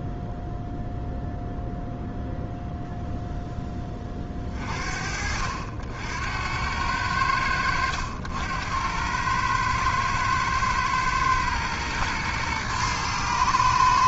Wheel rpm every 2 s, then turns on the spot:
0, 0, 30, 90, 90, 110, 110.
none